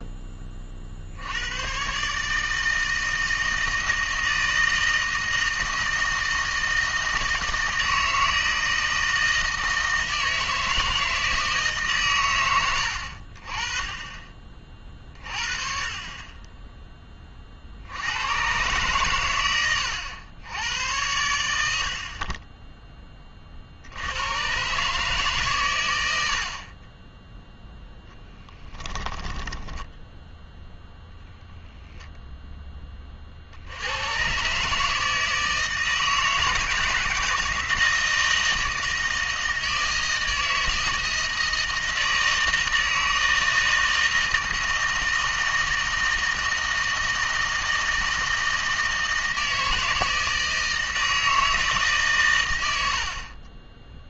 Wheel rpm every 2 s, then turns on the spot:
40, 160, 160, 160, 160, 160, 80, 40, 20, 120, 100, 20, 130, 30, 10, 10, 20, 150, 160, 160, 160, 160, 160, 160, 160, 160, 90.
28-30